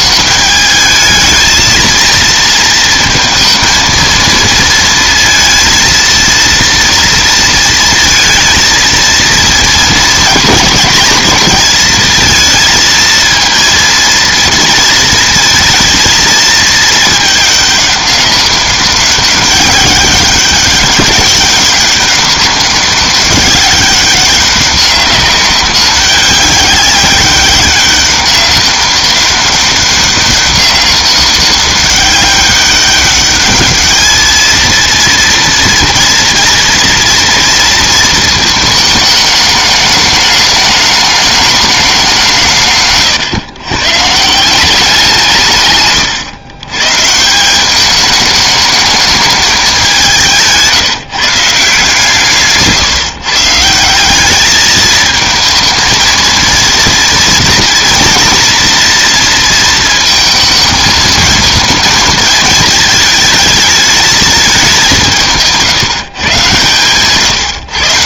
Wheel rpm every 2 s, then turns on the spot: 210, 230, 230, 230, 230, 220, 220, 230, 220, 200, 200, 200, 190, 200, 200, 200, 200, 230, 230, 220, 210, 140, 180, 130, 210, 170, 150, 210, 230, 230, 220, 220, 200, 130.
none